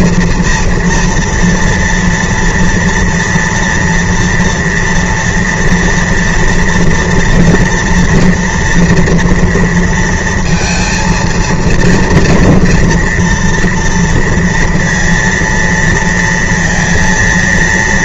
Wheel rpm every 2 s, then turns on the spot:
240, 230, 240, 230, 230, 230, 240, 230, 230.
none